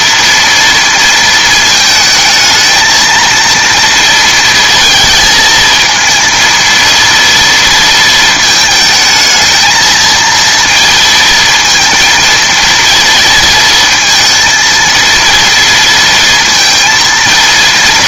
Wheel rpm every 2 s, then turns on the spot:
230, 220, 230, 230, 220, 230, 230, 230, 230.
none